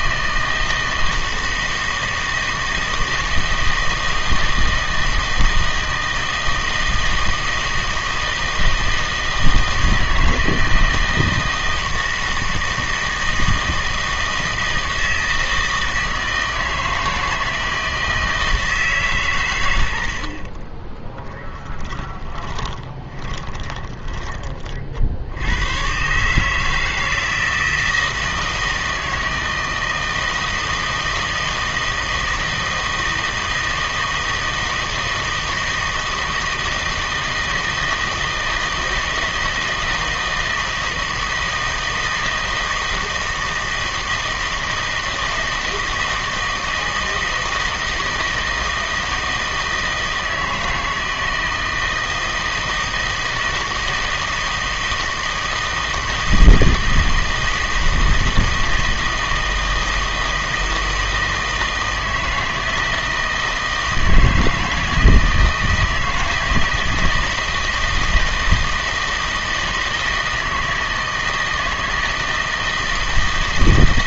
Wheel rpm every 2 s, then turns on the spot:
160, 160, 160, 160, 160, 160, 160, 160, 160, 160, 40, 20, 40, 150, 160, 160, 160, 160, 160, 160, 160, 160, 160, 160, 160, 160, 160, 160, 160, 160, 160, 160, 160, 160, 160, 160, 160.
20-24